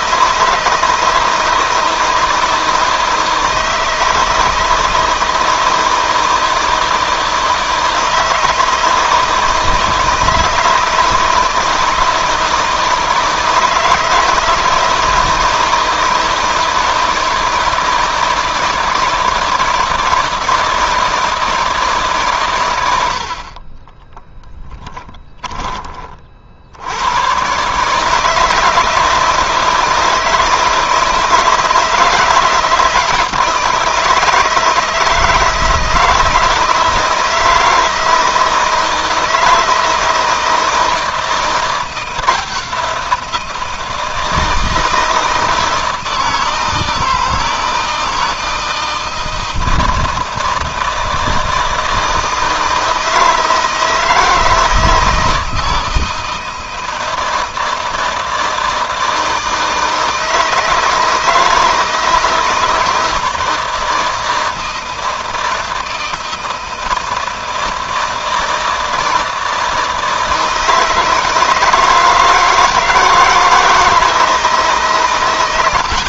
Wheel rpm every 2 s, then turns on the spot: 160, 160, 160, 160, 160, 160, 160, 160, 160, 160, 160, 80, 10, 90, 170, 160, 160, 160, 160, 160, 160, 170, 160, 160, 160, 160, 160, 160, 160, 160, 160, 160, 160, 160, 160, 160, 160, 140.
24-26